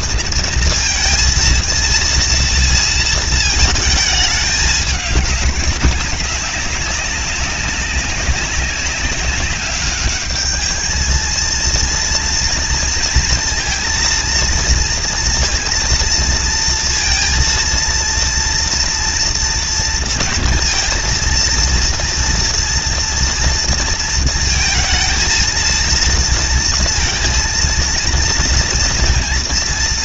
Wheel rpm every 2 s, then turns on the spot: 230, 230, 210, 200, 190, 210, 230, 230, 230, 230, 230, 230, 230, 230, 230.
none